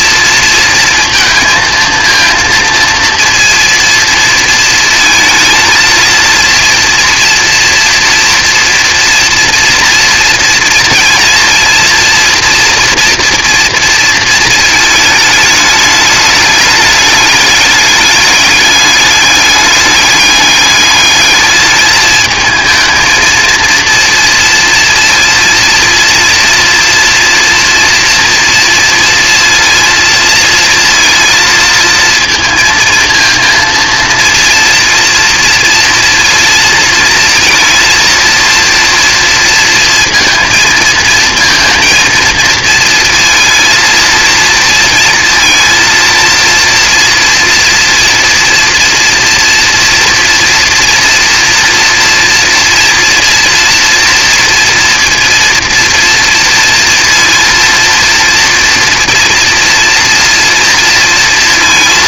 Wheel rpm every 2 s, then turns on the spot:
230, 230, 230, 230, 240, 230, 230, 230, 210, 210, 210, 220, 230, 230, 230, 230, 230, 230, 230, 230, 230, 230, 230, 230, 230, 230, 230, 230, 230, 230, 240.
none